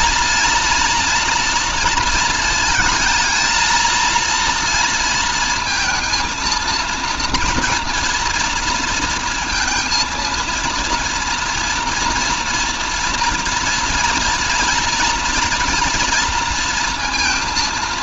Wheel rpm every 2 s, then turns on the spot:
230, 220, 230, 240, 230, 230, 240, 230, 230.
none